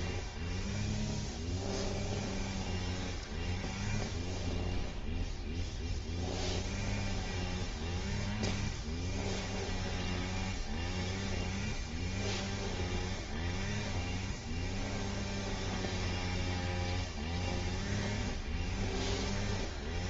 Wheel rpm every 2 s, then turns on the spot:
0, 0, 0, 0, 0, 0, 0, 0, 0, 0.
none